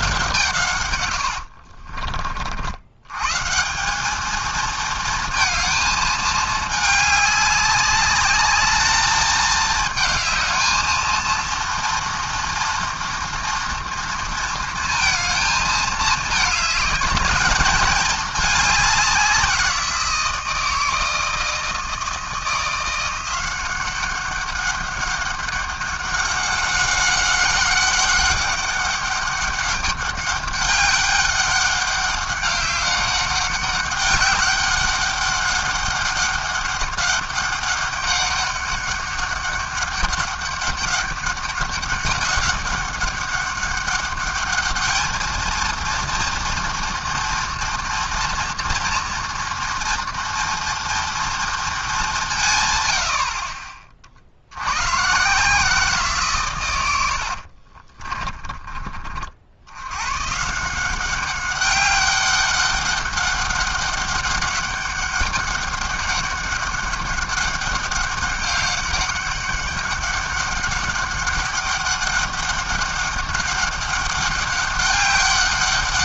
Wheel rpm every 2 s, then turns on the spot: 130, 80, 220, 210, 210, 220, 240, 230, 210, 200, 160, 160, 190, 200, 200, 200, 200, 200, 200, 200, 200, 200, 210, 230, 230, 230, 120, 100, 110, 20, 170, 200, 200, 200, 200, 200, 200, 200.
none